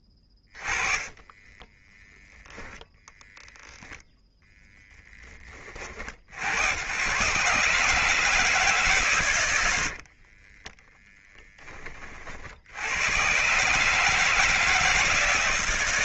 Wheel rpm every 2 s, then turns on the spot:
20, 10, 10, 100, 150, 20, 70, 160.
0-2 4-6 10-12